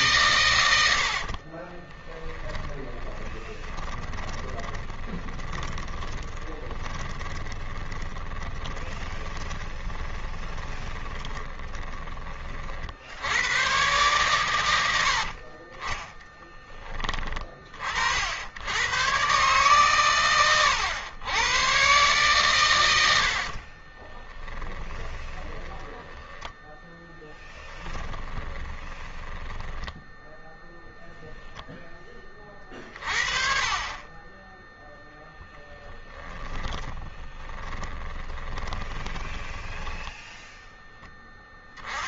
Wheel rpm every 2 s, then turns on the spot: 120, 20, 20, 20, 20, 20, 30, 120, 20, 80, 110, 130, 20, 10, 20, 10, 30, 20, 10, 20, 10.
0-12 24-26 28-30 36-40